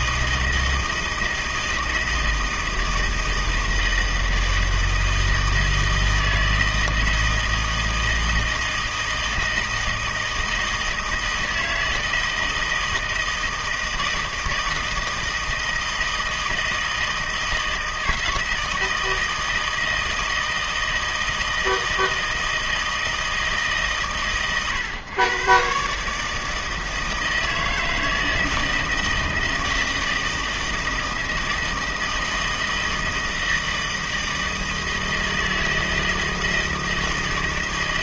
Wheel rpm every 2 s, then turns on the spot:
160, 160, 160, 160, 160, 160, 160, 160, 160, 160, 160, 160, 130, 160, 160, 160, 160, 160, 160.
none